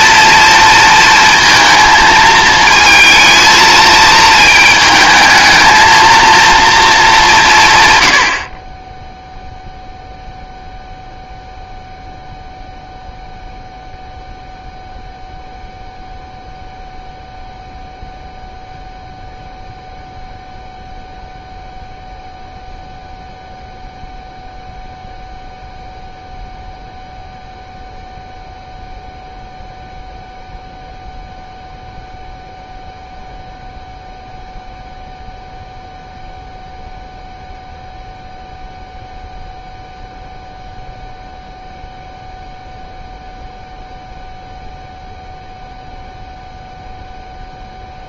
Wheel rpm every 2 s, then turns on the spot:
230, 220, 220, 230, 20, 0, 0, 0, 0, 0, 0, 0, 0, 0, 0, 0, 0, 0, 0, 0, 0, 0, 0, 0.
none